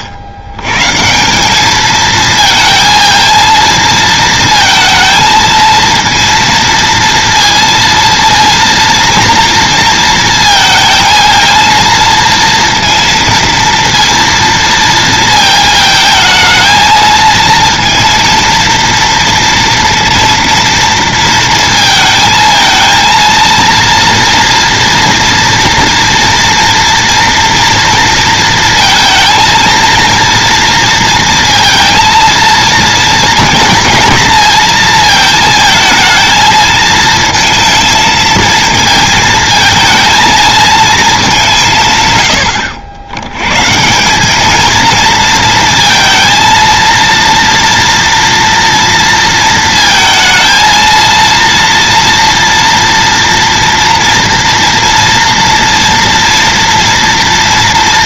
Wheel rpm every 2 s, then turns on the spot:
130, 220, 230, 230, 230, 220, 230, 230, 220, 230, 230, 220, 230, 230, 230, 230, 230, 220, 220, 230, 220, 80, 230, 230, 230, 230, 240, 240, 230.
none